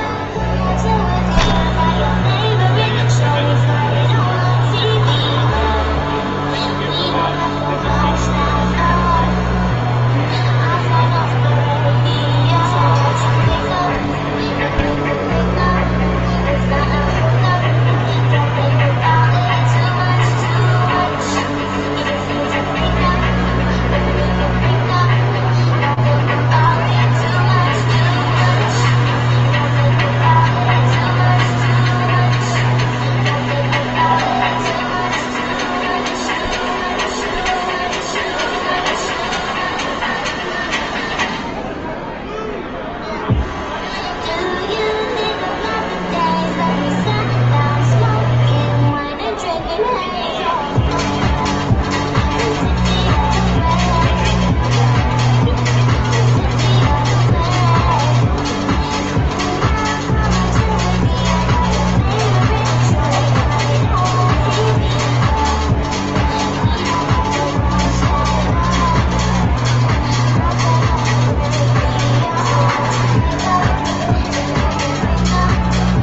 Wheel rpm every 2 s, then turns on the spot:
0, 0, 0, 0, 0, 0, 0, 0, 0, 0, 0, 0, 0, 0, 0, 0, 0, 0, 0, 0, 0, 0, 0, 0, 0, 0, 0, 0, 0, 0, 0, 0, 0, 0, 0, 0, 0, 0.
none